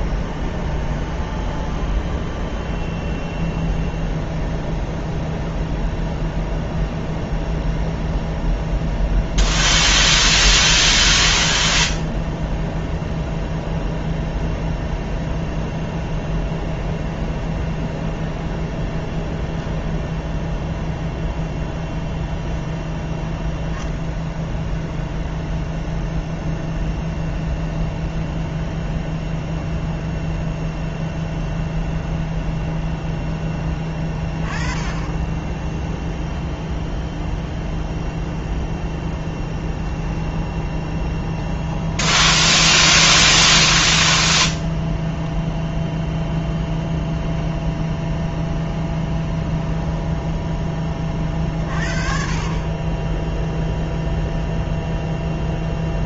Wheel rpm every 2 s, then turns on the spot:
0, 0, 0, 0, 0, 0, 0, 0, 0, 0, 0, 0, 0, 0, 0, 0, 0, 20, 0, 0, 10, 10, 0, 0, 10, 10, 30, 0.
40-44